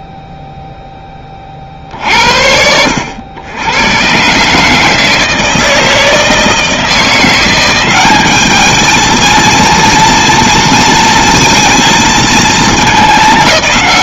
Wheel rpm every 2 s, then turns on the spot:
10, 80, 150, 160, 210, 230, 210.
none